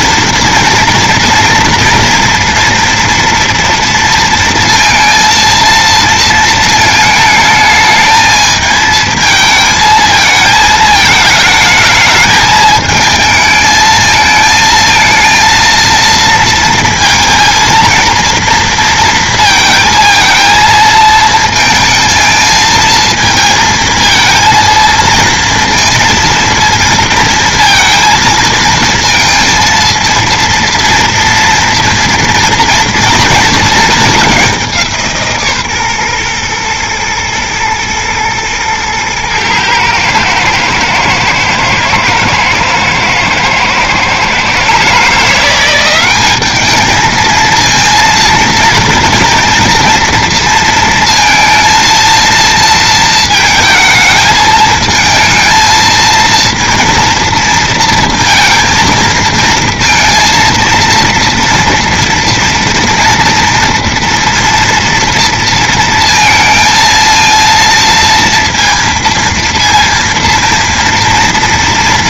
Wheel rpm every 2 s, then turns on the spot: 230, 230, 230, 220, 220, 220, 220, 220, 230, 230, 230, 220, 230, 230, 220, 230, 230, 190, 120, 110, 110, 110, 130, 210, 230, 230, 230, 220, 230, 230, 230, 230, 230, 230, 230, 230.
none